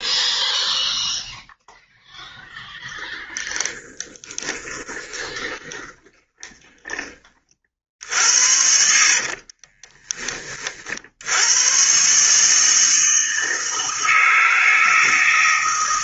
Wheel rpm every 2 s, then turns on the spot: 0, 0, 20, 20, 60, 50, 160, 160.
4-10